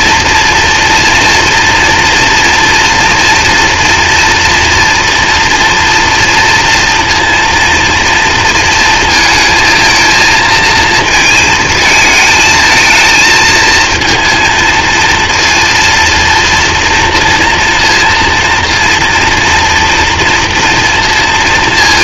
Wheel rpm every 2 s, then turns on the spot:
230, 230, 240, 230, 230, 220, 220, 230, 230, 230, 230.
none